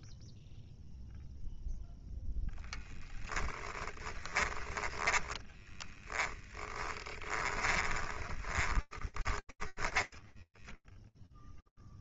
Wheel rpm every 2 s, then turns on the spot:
0, 10, 20, 20, 20, 0.
2-10